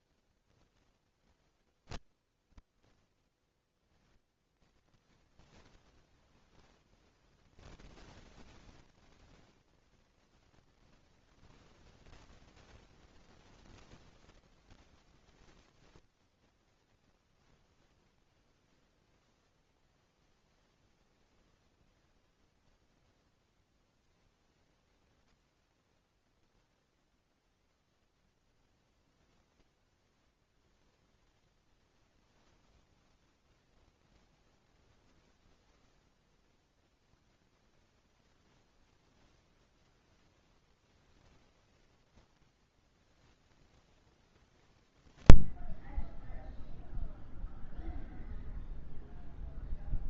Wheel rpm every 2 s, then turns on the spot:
0, 0, 0, 0, 0, 0, 0, 0, 0, 0, 0, 0, 0, 0, 0, 10, 0, 0, 0, 0, 0, 0, 20, 0, 0.
none